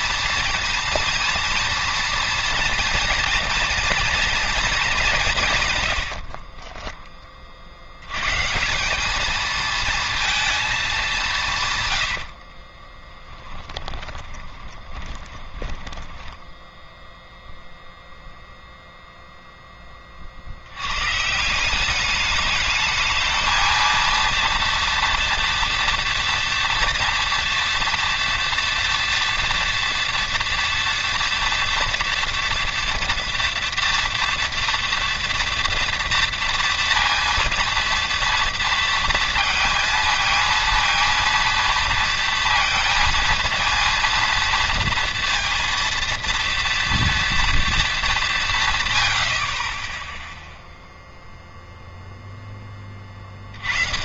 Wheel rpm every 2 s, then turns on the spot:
230, 240, 220, 10, 160, 220, 30, 20, 0, 0, 90, 210, 230, 230, 230, 230, 230, 230, 230, 230, 230, 230, 230, 230, 140, 0, 20.
6-8 12-16